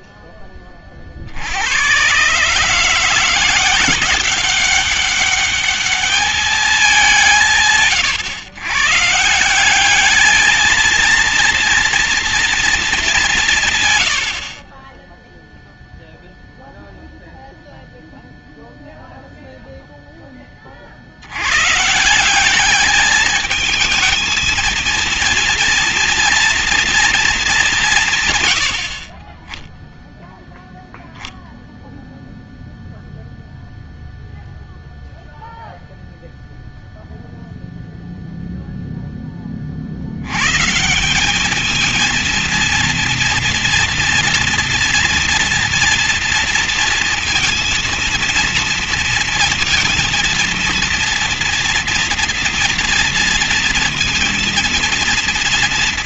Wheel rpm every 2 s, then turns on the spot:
20, 150, 190, 210, 130, 210, 230, 70, 0, 0, 20, 190, 230, 240, 130, 0, 0, 0, 0, 0, 110, 230, 230, 230, 230, 230, 230, 230.
none